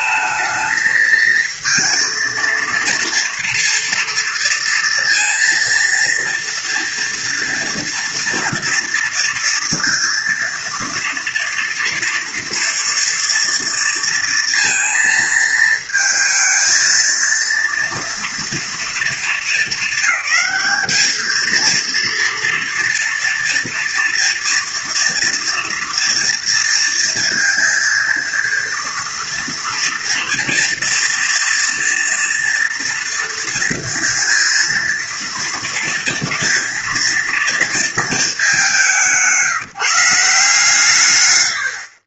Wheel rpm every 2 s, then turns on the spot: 220, 230, 230, 230, 230, 230, 230, 230, 230, 230, 220, 230, 240, 230, 230, 230, 230, 230, 230, 200, 140.
none